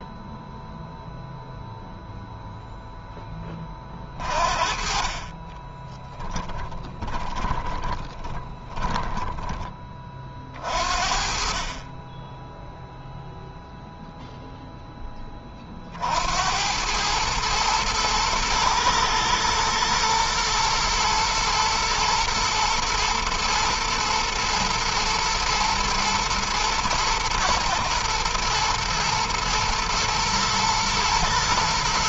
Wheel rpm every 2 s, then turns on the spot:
0, 10, 30, 20, 20, 40, 0, 10, 100, 110, 110, 110, 120, 110, 120, 120.
6-10